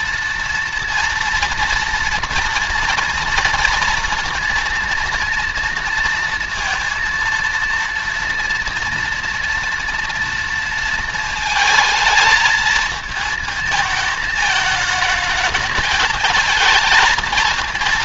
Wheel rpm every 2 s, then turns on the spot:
230, 240, 230, 230, 230, 230, 220, 210, 220.
none